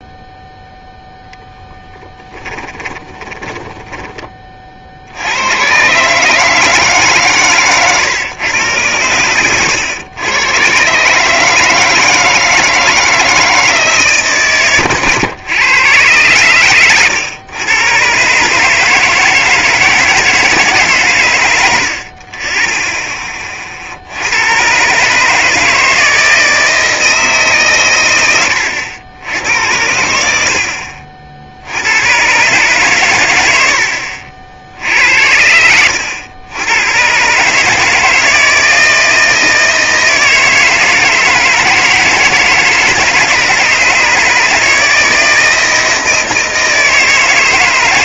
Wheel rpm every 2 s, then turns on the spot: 0, 10, 30, 150, 120, 130, 160, 120, 120, 150, 150, 20, 110, 160, 90, 70, 130, 70, 100, 160, 160, 160, 160, 160.
2-4